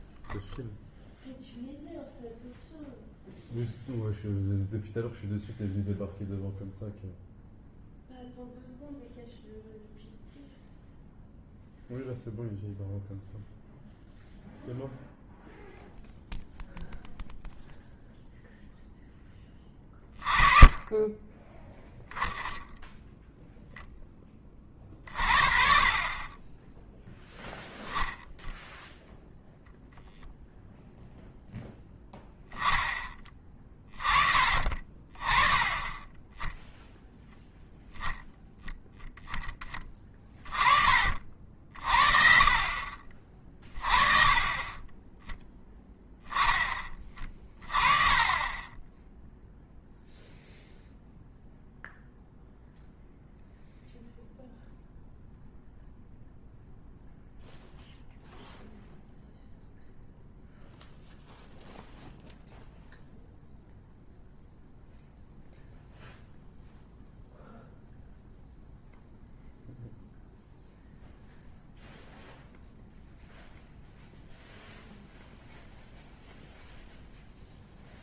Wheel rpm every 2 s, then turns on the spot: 0, 0, 0, 0, 0, 0, 0, 0, 0, 0, 30, 0, 20, 20, 0, 0, 10, 30, 10, 0, 20, 40, 30, 10, 20, 0, 0, 0, 0, 0, 0, 0, 0, 0, 0, 0, 0, 0, 0.
none